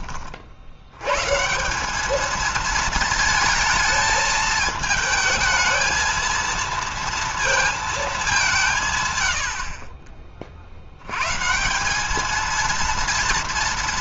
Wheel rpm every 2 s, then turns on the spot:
60, 220, 220, 230, 170, 50, 220.
none